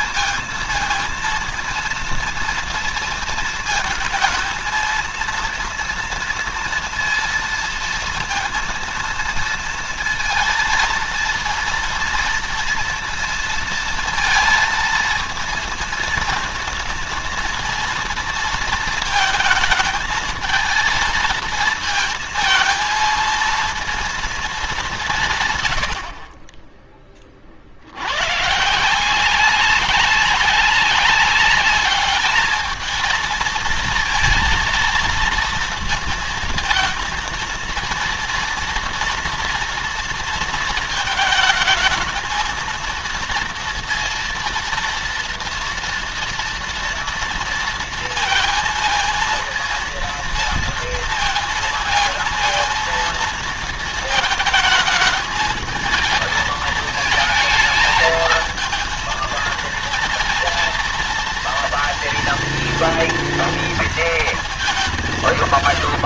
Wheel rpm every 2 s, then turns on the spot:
230, 230, 230, 230, 230, 230, 230, 230, 230, 230, 230, 230, 190, 20, 160, 190, 220, 230, 230, 230, 220, 230, 230, 240, 230, 230, 230, 210, 220, 220, 230, 230, 180.
none